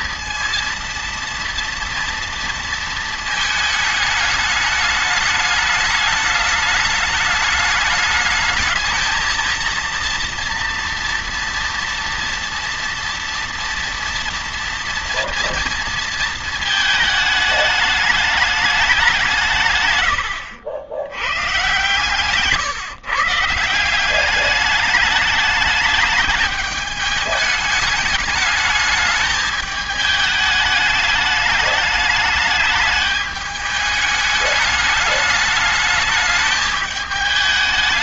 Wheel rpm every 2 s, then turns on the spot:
230, 230, 210, 210, 220, 230, 230, 230, 220, 200, 90, 140, 200, 210, 210, 210, 210, 210, 210.
none